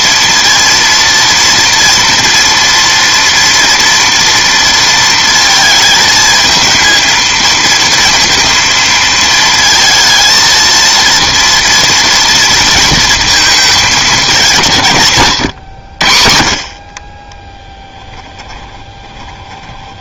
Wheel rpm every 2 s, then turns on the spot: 230, 230, 230, 220, 230, 230, 230, 170, 60, 20.
18-20